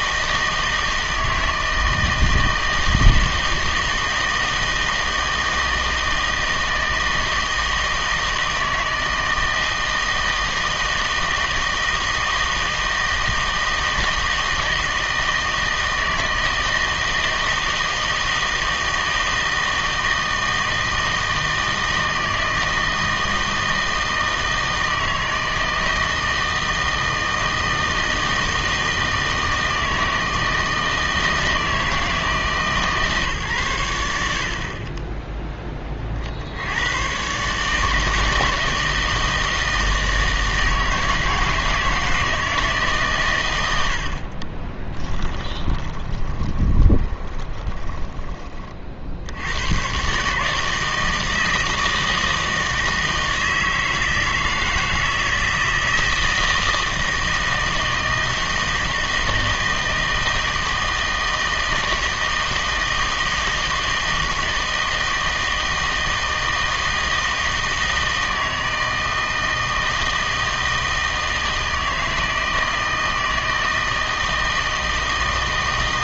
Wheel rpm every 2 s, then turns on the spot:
160, 160, 160, 160, 160, 160, 160, 160, 160, 160, 160, 160, 160, 160, 160, 160, 150, 50, 80, 160, 160, 160, 20, 20, 30, 150, 160, 160, 160, 160, 160, 160, 160, 160, 160, 160, 160, 160.
44-48